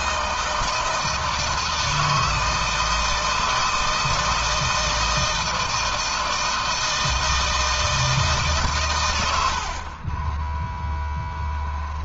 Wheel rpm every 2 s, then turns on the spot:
160, 160, 160, 160, 90, 0.
none